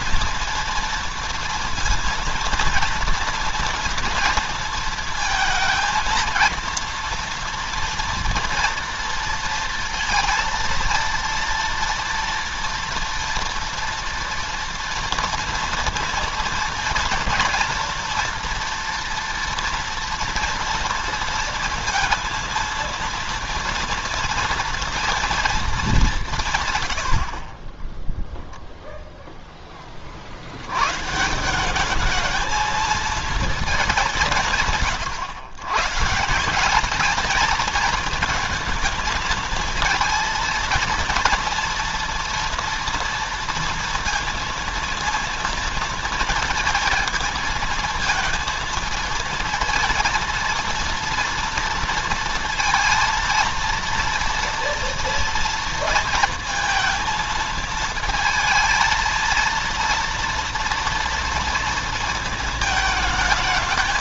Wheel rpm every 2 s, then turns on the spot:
230, 230, 230, 230, 230, 230, 230, 230, 230, 230, 230, 230, 230, 160, 0, 80, 220, 140, 180, 220, 230, 230, 230, 230, 230, 230, 230, 230, 230, 220, 230, 220.
none